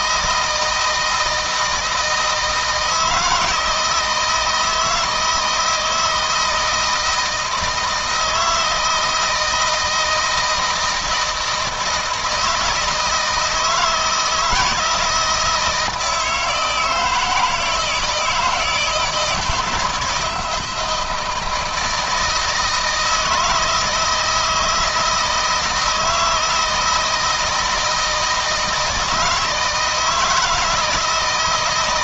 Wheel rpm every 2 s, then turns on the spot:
160, 160, 160, 160, 160, 160, 160, 170, 160, 160, 160, 160, 160, 160, 160, 160.
none